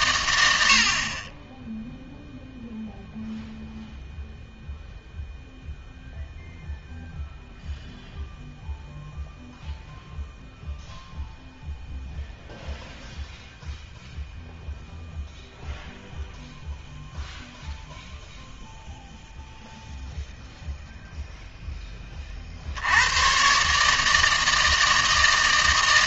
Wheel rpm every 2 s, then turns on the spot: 80, 0, 0, 0, 0, 0, 0, 0, 0, 0, 0, 60, 160.
none